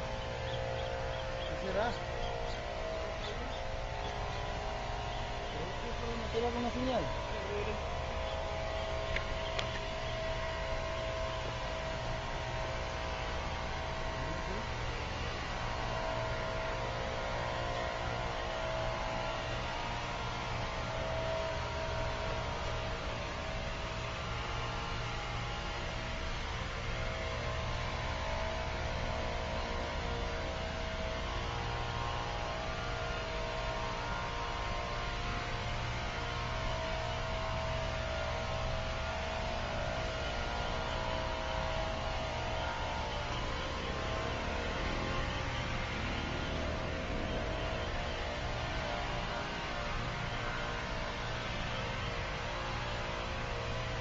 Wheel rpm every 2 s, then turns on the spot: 0, 0, 0, 0, 0, 0, 0, 0, 0, 0, 0, 0, 0, 0, 0, 0, 0, 0, 0, 0, 0, 0, 0, 0, 0, 0, 0.
none